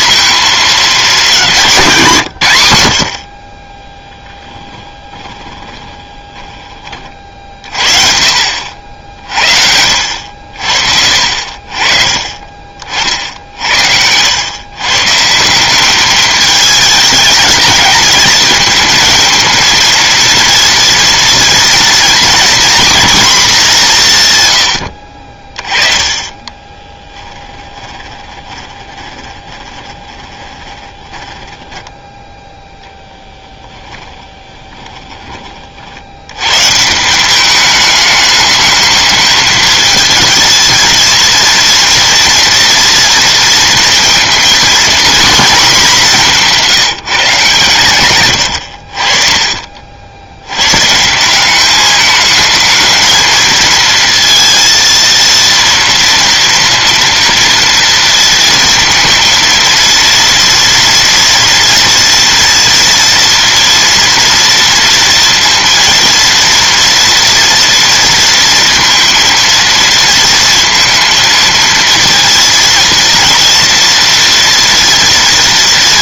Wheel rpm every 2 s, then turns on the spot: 210, 80, 20, 40, 60, 60, 40, 130, 210, 230, 230, 240, 80, 20, 20, 20, 0, 20, 150, 210, 220, 230, 240, 180, 70, 130, 220, 230, 230, 230, 230, 230, 230, 230, 230, 230, 230, 230.
4-6 26-32 34-36